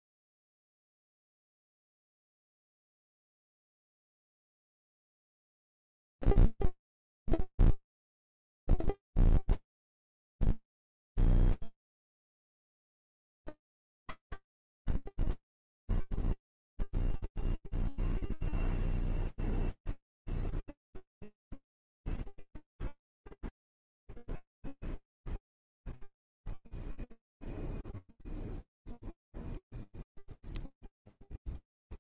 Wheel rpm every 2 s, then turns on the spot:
0, 10, 10, 0, 0, 0, 0, 10, 0, 0, 0, 0, 0, 0, 0, 0.
none